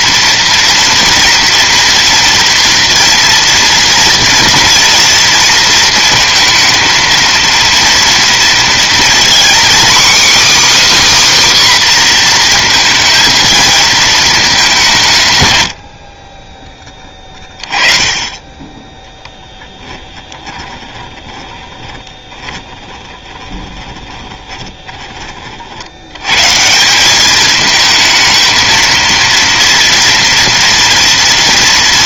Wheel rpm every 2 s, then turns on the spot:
230, 230, 230, 230, 230, 290, 240, 210, 20, 20, 20, 20, 20, 130, 220, 230.
20-26